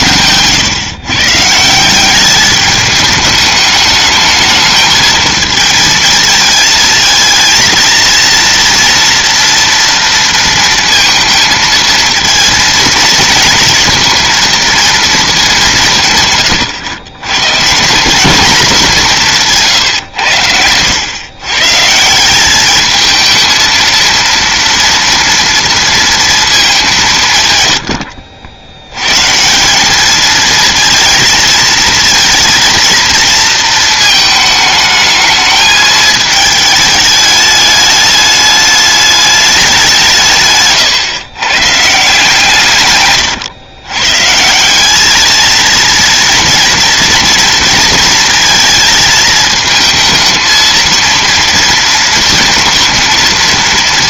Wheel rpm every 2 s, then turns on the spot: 130, 210, 220, 230, 230, 230, 220, 230, 120, 200, 100, 210, 230, 200, 90, 220, 230, 220, 220, 210, 150, 140, 180, 230, 220, 230, 230.
none